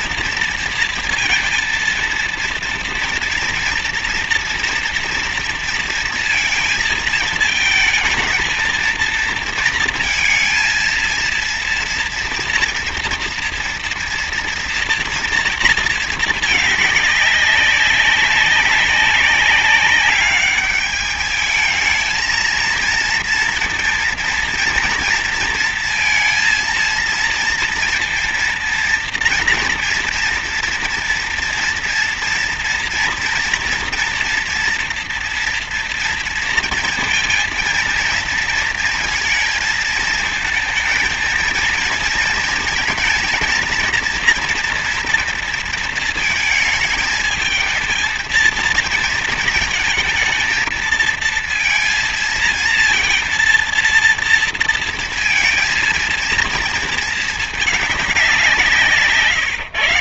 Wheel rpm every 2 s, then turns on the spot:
230, 230, 230, 230, 220, 230, 230, 240, 210, 190, 210, 230, 240, 230, 230, 230, 230, 230, 230, 230, 220, 230, 240, 220, 230, 220, 230, 230, 230, 170.
none